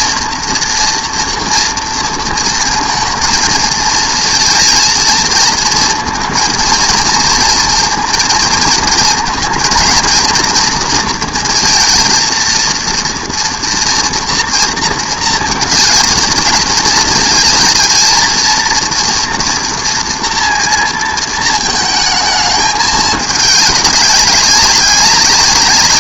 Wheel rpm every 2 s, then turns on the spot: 240, 230, 230, 230, 230, 230, 230, 230, 230, 230, 230, 210, 200.
none